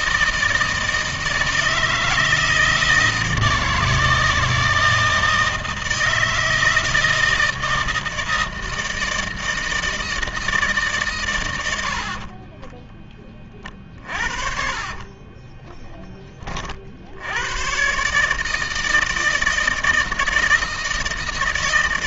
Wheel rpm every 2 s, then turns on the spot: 160, 160, 160, 160, 160, 160, 30, 40, 30, 160, 160.
14-16